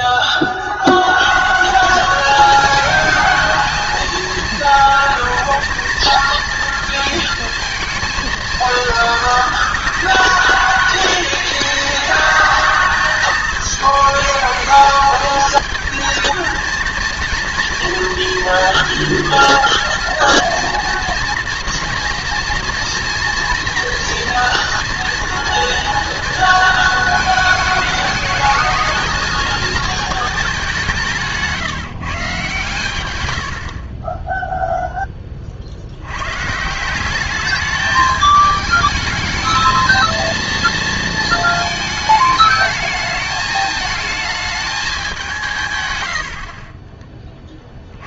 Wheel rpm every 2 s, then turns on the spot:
40, 210, 230, 230, 230, 220, 220, 220, 230, 230, 240, 230, 230, 230, 220, 190, 130, 0, 150, 210, 230, 220, 210, 50.
none